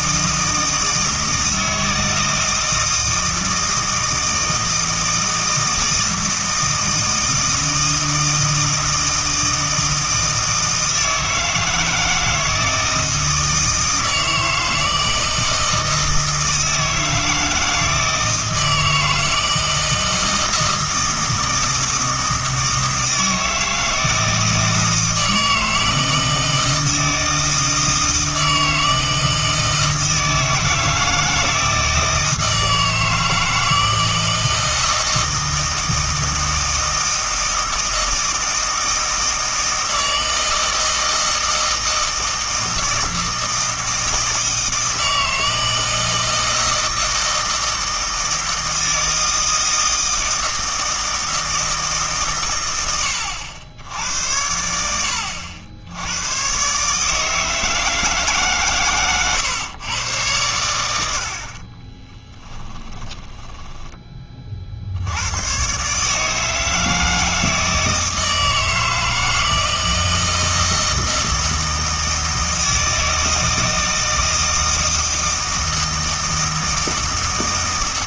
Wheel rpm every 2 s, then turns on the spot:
160, 160, 160, 160, 160, 160, 160, 160, 160, 160, 160, 160, 160, 160, 160, 160, 160, 160, 160, 160, 160, 160, 160, 160, 160, 160, 110, 90, 140, 130, 90, 10, 60, 160, 160, 160, 160, 160, 160.
62-64